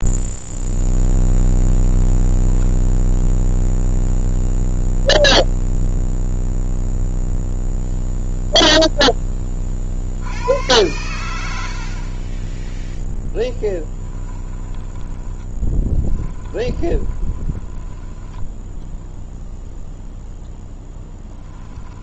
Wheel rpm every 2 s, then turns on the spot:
0, 10, 0, 0, 0, 100, 10, 10, 20, 10, 0.
12-18